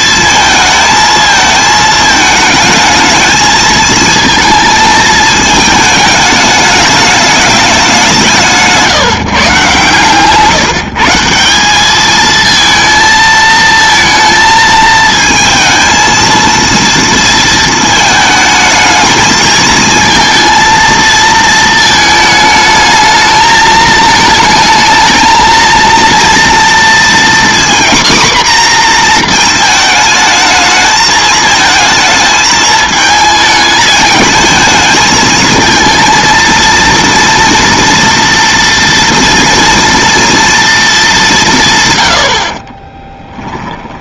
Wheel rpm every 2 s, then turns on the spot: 220, 220, 220, 210, 180, 150, 220, 220, 230, 220, 230, 220, 220, 230, 250, 220, 220, 220, 230, 230, 230, 80.
none